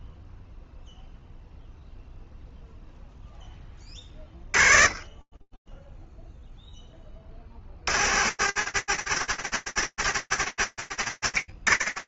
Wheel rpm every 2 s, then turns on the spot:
0, 10, 10, 70, 160, 130.
none